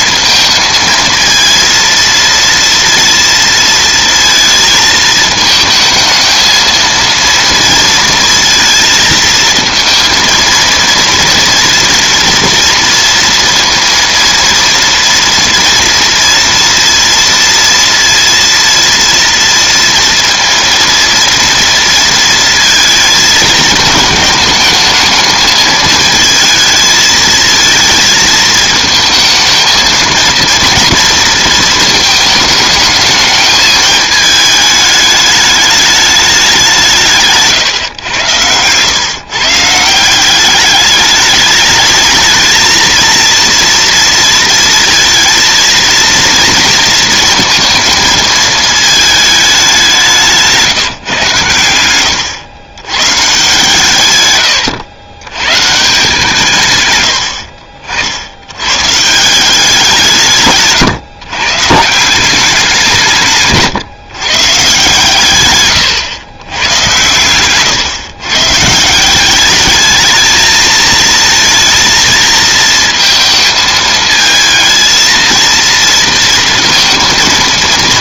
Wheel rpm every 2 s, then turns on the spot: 220, 230, 220, 230, 230, 230, 230, 230, 230, 230, 230, 220, 220, 220, 220, 230, 220, 210, 180, 120, 200, 230, 230, 230, 220, 140, 110, 100, 130, 120, 140, 170, 150, 110, 150, 220, 220, 220, 230.
none